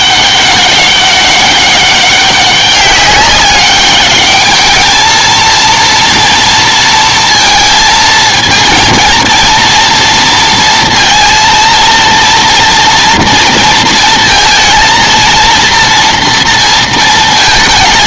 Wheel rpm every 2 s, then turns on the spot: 200, 200, 200, 230, 220, 230, 230, 230, 230.
none